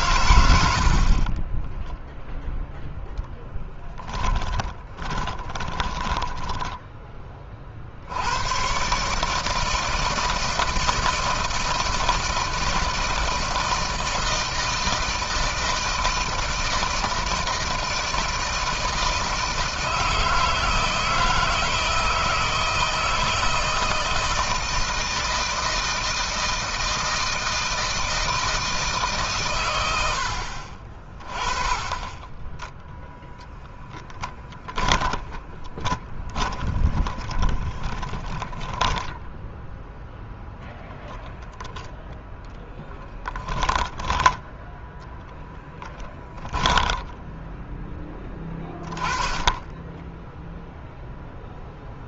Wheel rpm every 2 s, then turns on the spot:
80, 0, 20, 10, 110, 160, 160, 160, 160, 160, 160, 160, 160, 160, 160, 50, 10, 10, 20, 10, 0, 10, 10, 10, 10, 0.
4-6 36-40 42-44 46-48